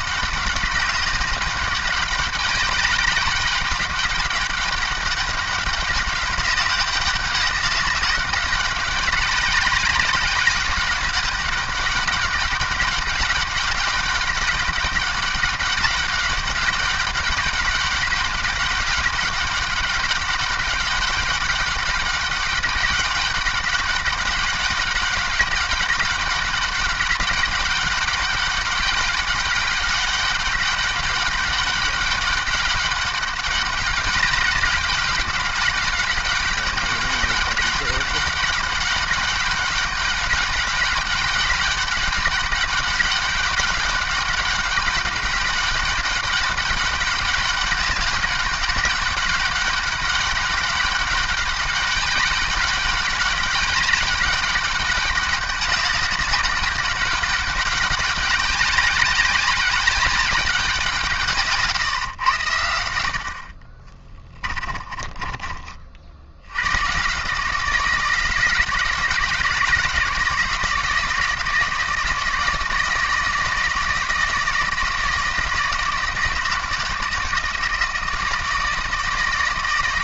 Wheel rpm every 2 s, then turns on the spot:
190, 190, 200, 190, 200, 200, 200, 200, 200, 200, 190, 200, 190, 190, 190, 200, 200, 200, 200, 200, 190, 200, 200, 200, 200, 200, 200, 200, 200, 200, 180, 80, 30, 100, 170, 160, 170, 160, 160, 160.
64-66